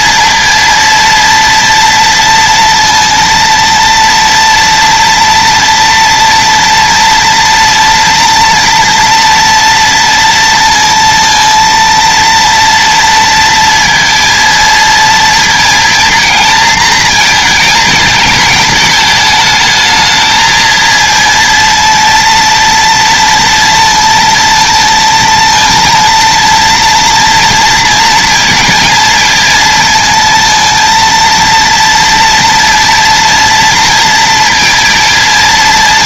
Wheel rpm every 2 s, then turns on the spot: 230, 230, 230, 230, 230, 230, 230, 230, 220, 220, 230, 230, 230, 230, 230, 230, 230, 230.
none